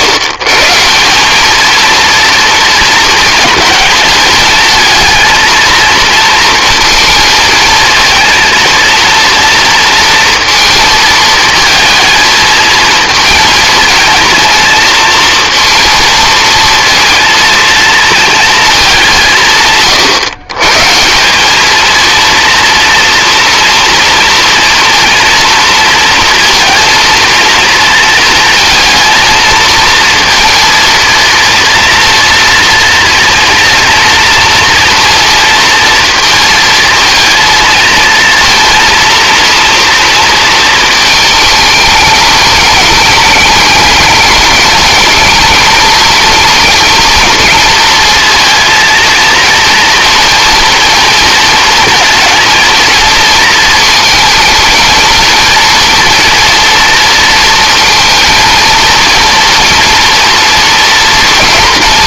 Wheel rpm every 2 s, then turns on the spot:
140, 230, 220, 230, 230, 220, 220, 230, 230, 210, 150, 240, 230, 230, 230, 230, 230, 230, 230, 230, 230, 210, 210, 230, 230, 230, 220, 230, 230, 230, 230.
none